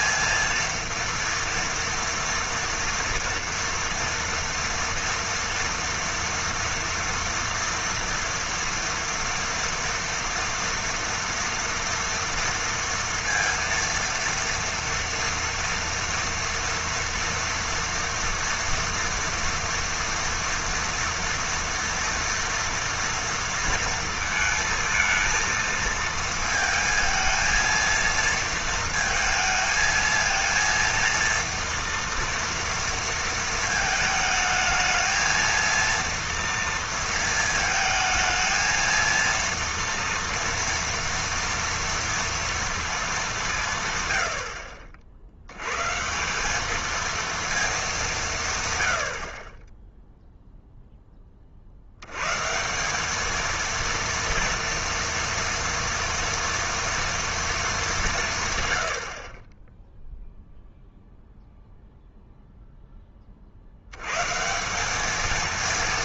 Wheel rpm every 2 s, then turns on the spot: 230, 230, 230, 230, 240, 230, 230, 230, 230, 230, 230, 230, 220, 230, 230, 230, 230, 220, 230, 230, 230, 220, 50, 220, 80, 0, 190, 230, 230, 70, 0, 10, 190.
none